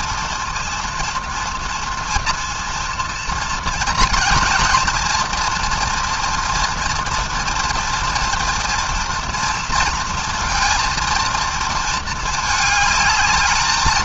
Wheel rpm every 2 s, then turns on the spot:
240, 230, 240, 230, 230, 230, 210.
none